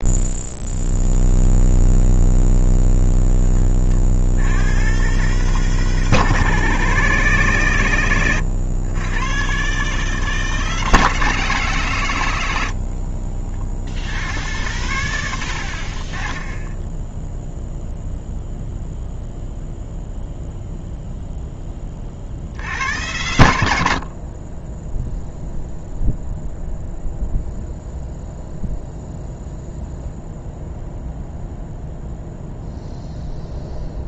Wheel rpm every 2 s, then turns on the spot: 0, 10, 120, 150, 110, 150, 60, 90, 0, 0, 0, 90, 10, 0, 0, 0, 0.
12-14